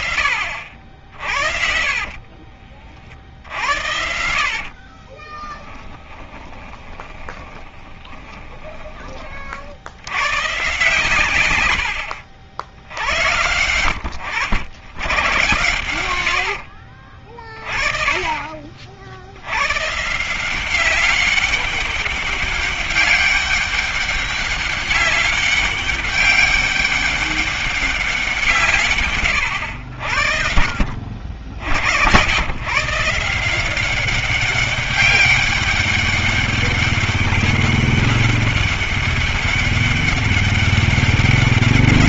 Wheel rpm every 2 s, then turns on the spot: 60, 40, 60, 10, 10, 110, 80, 90, 80, 40, 170, 200, 200, 200, 180, 60, 110, 200, 200, 200, 200.
2-10